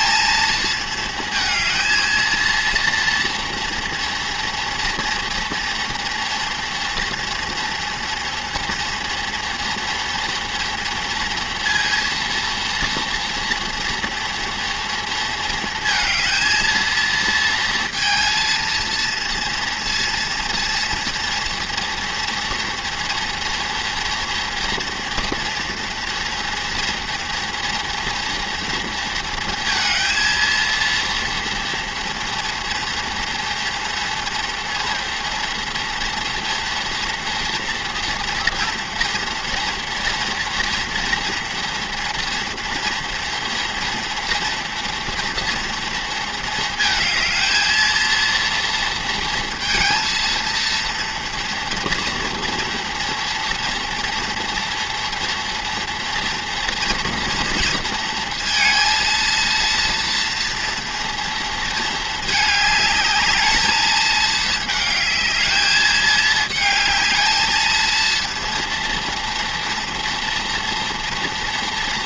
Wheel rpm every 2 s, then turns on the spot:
220, 230, 230, 230, 230, 230, 240, 230, 230, 230, 230, 240, 240, 240, 230, 230, 230, 240, 230, 230, 230, 230, 230, 220, 230, 230, 240, 230, 230, 230, 230, 210, 220, 220, 230, 230.
none